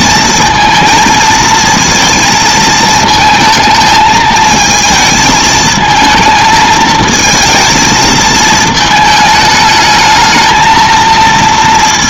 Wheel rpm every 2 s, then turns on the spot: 230, 220, 220, 220, 220, 220.
none